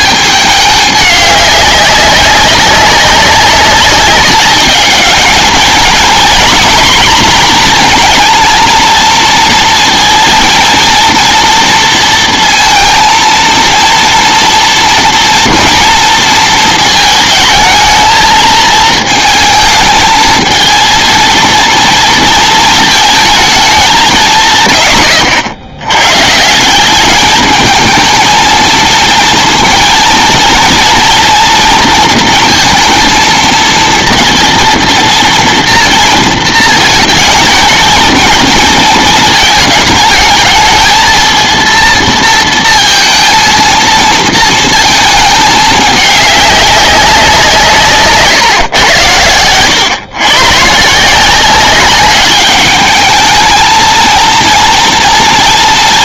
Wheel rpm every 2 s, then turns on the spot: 200, 190, 210, 230, 230, 230, 230, 230, 230, 220, 220, 230, 140, 180, 220, 230, 230, 230, 220, 230, 220, 230, 230, 200, 120, 150, 210, 230.
none